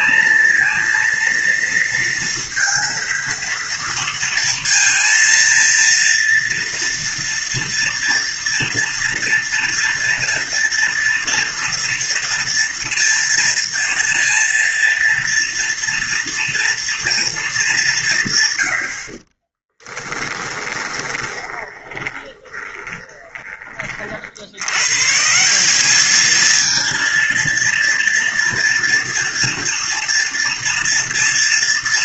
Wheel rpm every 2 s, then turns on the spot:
230, 230, 230, 230, 230, 230, 230, 230, 240, 70, 20, 20, 130, 230, 230, 230.
20-24